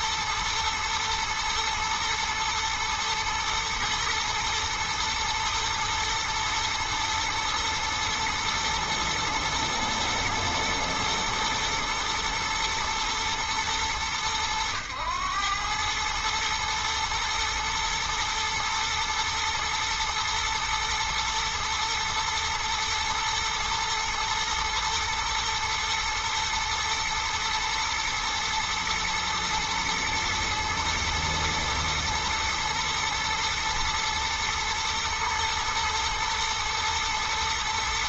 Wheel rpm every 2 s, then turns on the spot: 120, 110, 110, 120, 120, 120, 120, 100, 110, 120, 110, 110, 110, 120, 120, 120, 110, 110, 120.
none